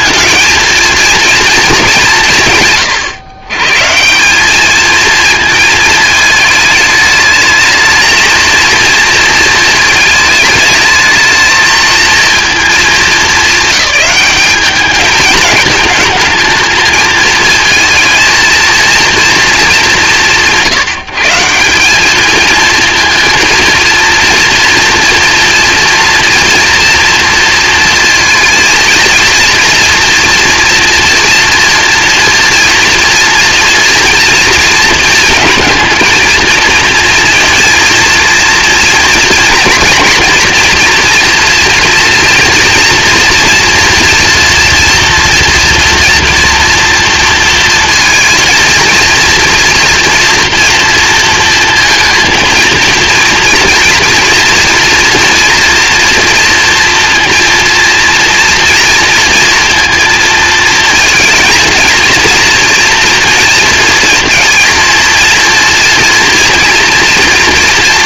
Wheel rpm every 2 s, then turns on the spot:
230, 160, 200, 220, 230, 220, 210, 200, 220, 230, 170, 220, 230, 240, 230, 240, 230, 230, 230, 230, 230, 240, 230, 240, 230, 230, 230, 240, 230, 230, 220, 230, 230, 230.
none